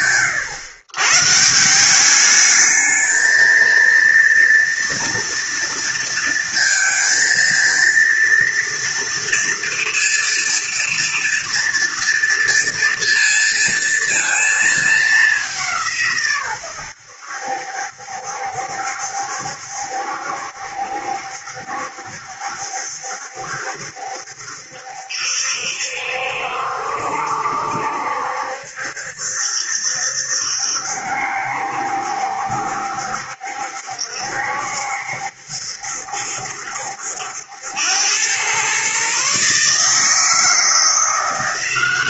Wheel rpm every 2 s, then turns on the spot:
120, 220, 230, 230, 240, 230, 230, 210, 90, 70, 70, 70, 70, 70, 70, 70, 70, 70, 70, 130, 170.
none